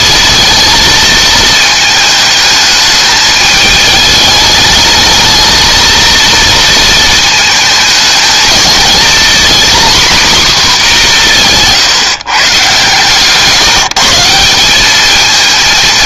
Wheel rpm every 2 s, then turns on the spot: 220, 210, 210, 230, 220, 240, 150, 190.
none